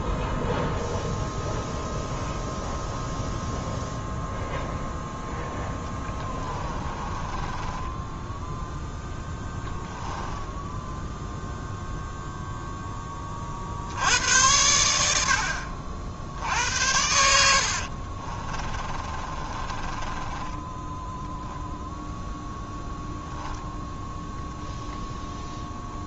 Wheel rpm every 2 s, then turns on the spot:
0, 0, 0, 20, 10, 10, 0, 80, 80, 30, 10, 0, 0.
6-8 10-12 18-22